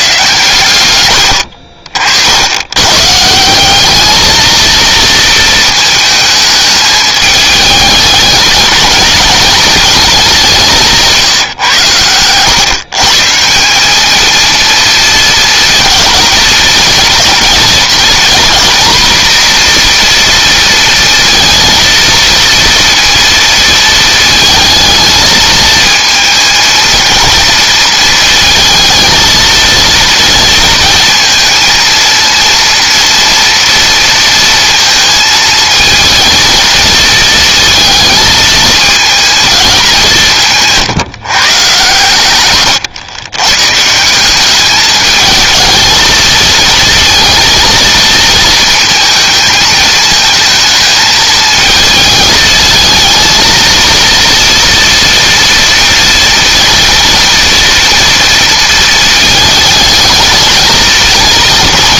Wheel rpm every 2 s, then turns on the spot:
120, 100, 230, 210, 210, 180, 130, 230, 230, 240, 230, 230, 220, 230, 230, 230, 230, 230, 220, 220, 160, 130, 210, 230, 230, 220, 220, 230, 230, 230, 220.
10-12